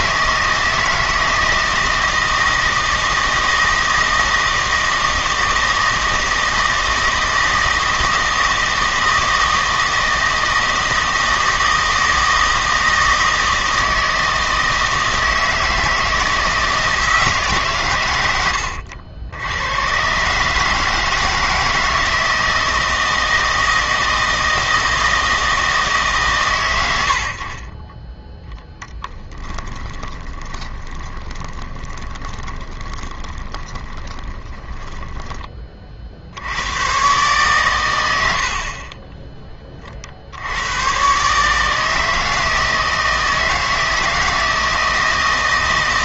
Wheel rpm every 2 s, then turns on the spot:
160, 160, 160, 160, 160, 160, 160, 160, 160, 80, 150, 160, 160, 110, 20, 20, 20, 20, 100, 50, 100, 160, 160.
28-36